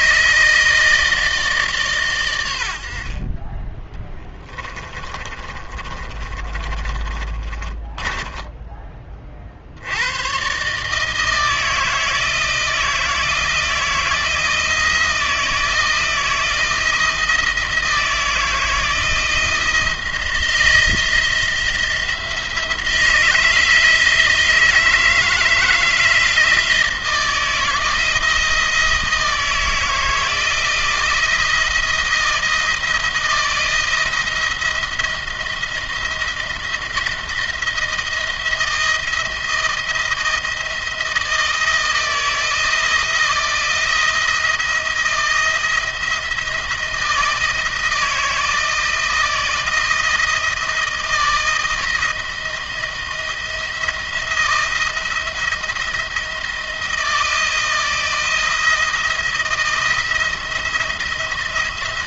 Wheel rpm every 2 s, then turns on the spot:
160, 80, 20, 30, 20, 140, 160, 170, 160, 160, 170, 170, 160, 160, 170, 170, 170, 170, 170, 170, 170, 160, 170, 160, 160, 160, 170, 170, 160, 170, 170.
4-10